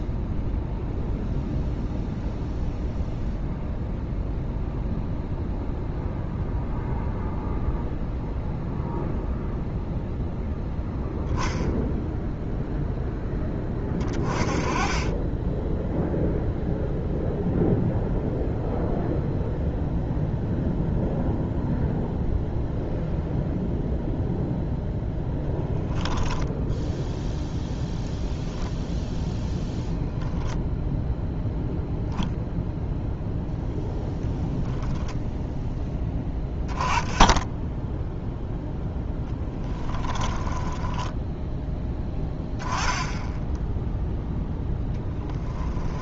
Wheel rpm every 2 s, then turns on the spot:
0, 0, 0, 0, 0, 10, 0, 20, 0, 0, 0, 0, 0, 0, 0, 0, 0, 0, 10, 0, 10, 20, 0.
40-42